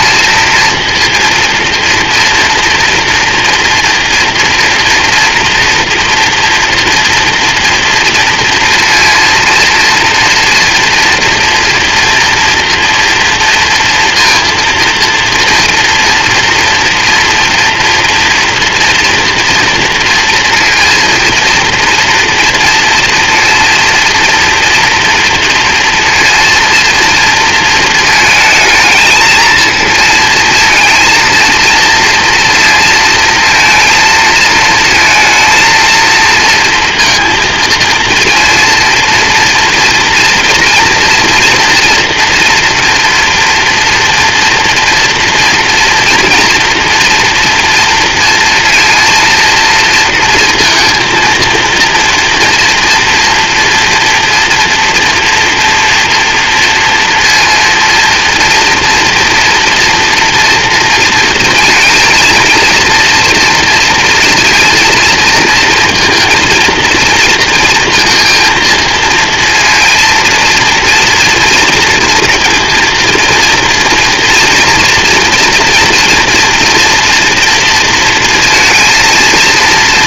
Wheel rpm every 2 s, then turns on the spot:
230, 240, 230, 230, 230, 230, 230, 230, 230, 230, 230, 230, 230, 230, 230, 230, 240, 230, 230, 230, 230, 240, 230, 240, 240, 230, 230, 230, 230, 230, 230, 230, 230, 230, 230, 230, 230, 230, 240, 230.
none